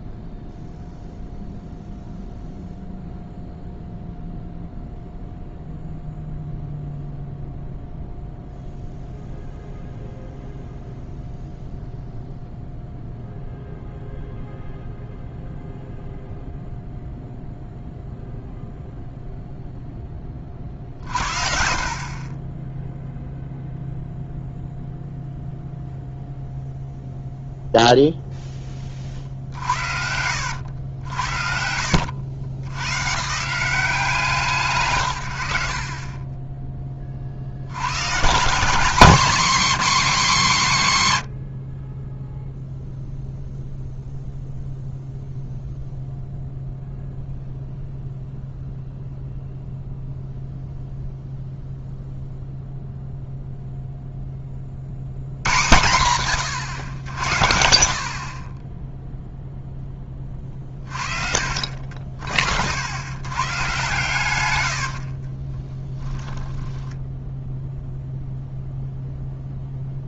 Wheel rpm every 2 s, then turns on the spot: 0, 0, 0, 0, 0, 0, 0, 0, 0, 50, 0, 0, 0, 10, 80, 80, 170, 20, 170, 220, 10, 0, 0, 0, 0, 0, 0, 120, 80, 10, 60, 120, 20, 0, 0.
34-36 40-42 64-66